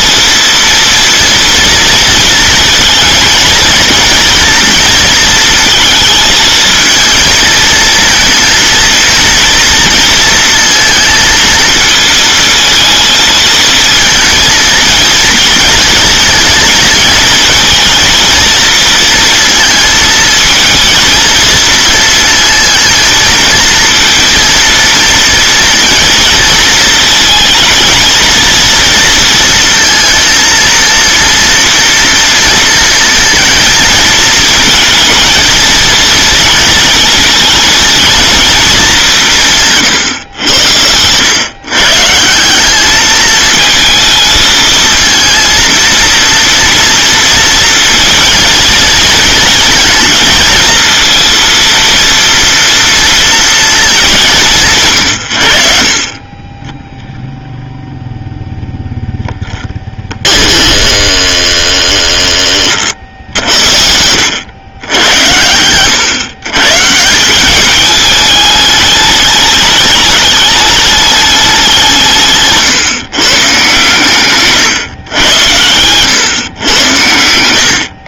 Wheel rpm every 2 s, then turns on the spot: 230, 220, 230, 230, 230, 230, 230, 230, 230, 230, 230, 230, 230, 220, 230, 230, 230, 220, 230, 200, 100, 210, 220, 230, 220, 230, 230, 150, 0, 0, 20, 40, 100, 140, 210, 210, 150, 110, 110.
60-62